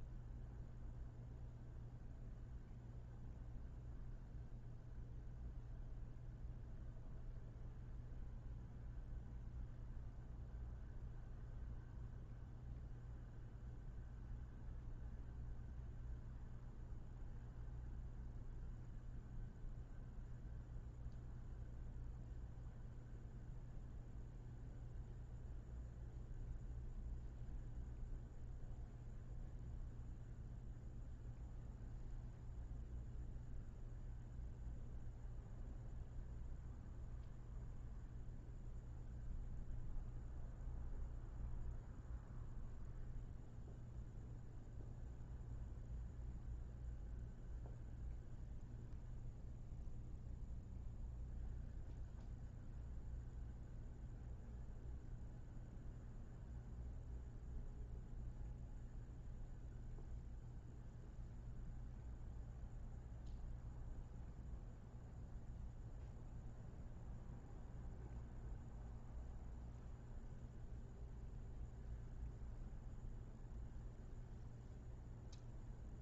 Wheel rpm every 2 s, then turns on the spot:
0, 0, 0, 0, 0, 0, 0, 0, 0, 0, 0, 0, 0, 0, 0, 0, 0, 0, 0, 0, 0, 0, 0, 0, 0, 0, 0, 0, 0, 0, 0, 0, 0, 0, 0, 0, 0, 0.
none